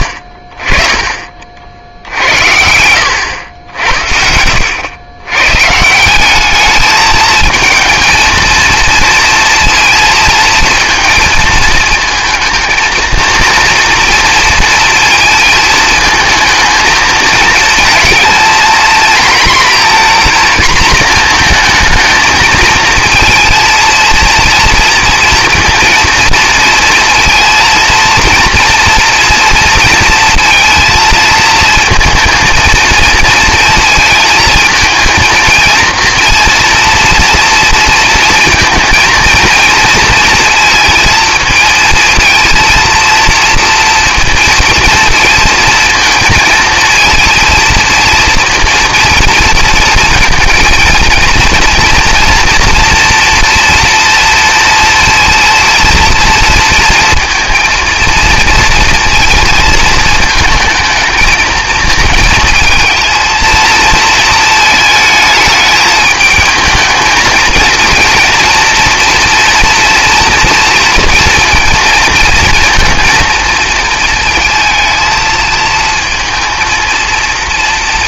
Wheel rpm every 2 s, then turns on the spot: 30, 80, 90, 210, 230, 230, 220, 230, 220, 230, 230, 220, 230, 230, 230, 230, 230, 230, 230, 230, 230, 230, 230, 230, 230, 230, 230, 230, 230, 230, 220, 220, 220, 220, 240, 230, 230, 230, 230.
2-4